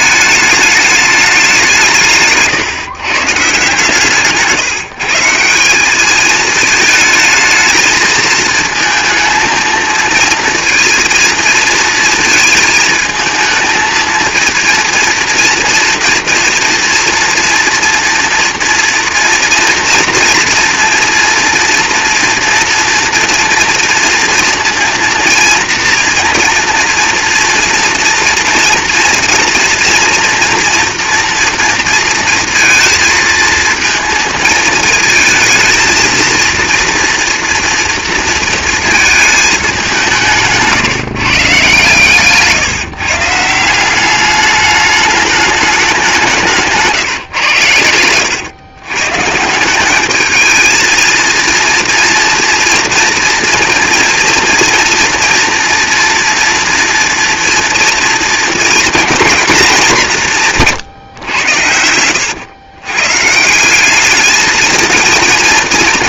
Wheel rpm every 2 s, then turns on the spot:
210, 130, 160, 210, 230, 230, 220, 230, 230, 230, 230, 230, 230, 230, 230, 240, 230, 220, 230, 230, 150, 140, 200, 160, 110, 220, 230, 230, 230, 230, 150, 120, 220.
46-48